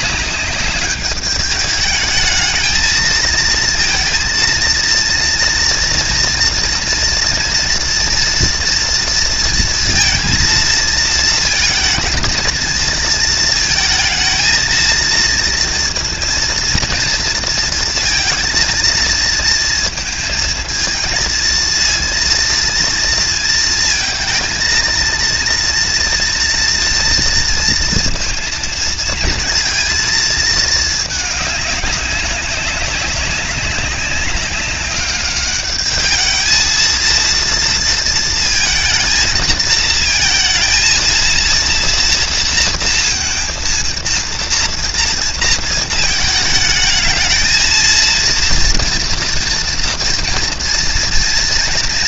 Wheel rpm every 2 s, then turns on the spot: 210, 230, 240, 230, 230, 220, 220, 230, 230, 220, 230, 230, 240, 230, 230, 210, 200, 210, 230, 220, 230, 230, 230, 220, 230, 230.
none